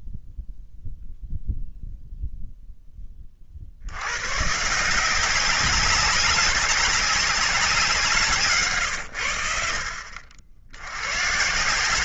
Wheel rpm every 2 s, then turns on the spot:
0, 0, 140, 190, 130, 90.
none